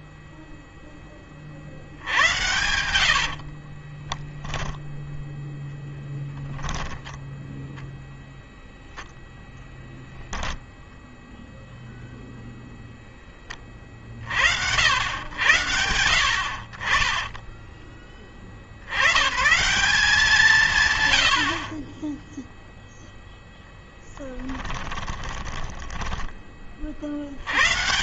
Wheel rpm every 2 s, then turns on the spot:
0, 90, 10, 10, 0, 0, 0, 80, 60, 60, 150, 0, 20, 30.
2-4 6-8 24-26